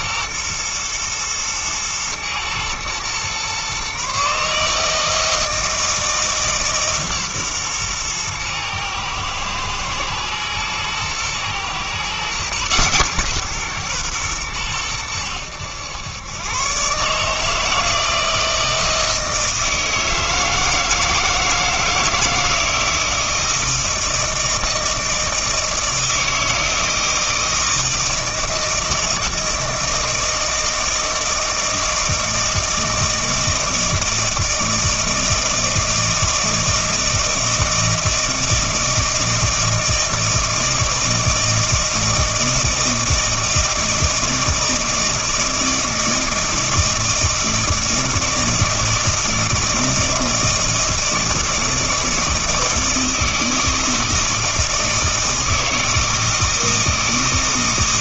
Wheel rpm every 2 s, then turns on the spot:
120, 120, 150, 150, 110, 110, 130, 110, 120, 160, 160, 160, 160, 160, 160, 160, 160, 160, 160, 160, 160, 160, 160, 160, 160, 160, 160, 160, 160.
none